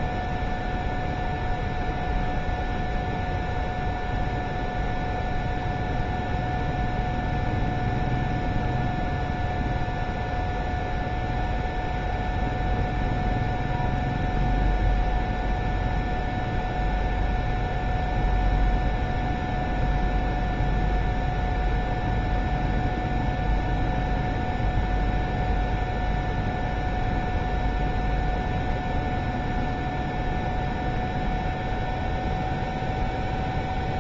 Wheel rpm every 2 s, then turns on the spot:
0, 0, 0, 0, 0, 0, 0, 0, 0, 0, 0, 0, 0, 0, 0, 0, 0.
none